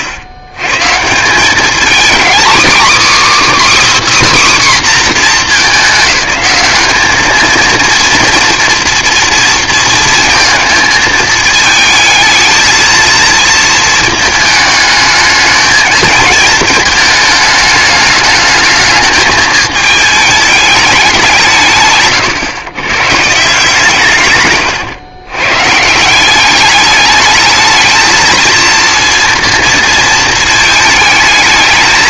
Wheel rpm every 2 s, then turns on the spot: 110, 260, 280, 210, 240, 230, 230, 220, 220, 210, 210, 130, 110, 200, 230, 220.
24-26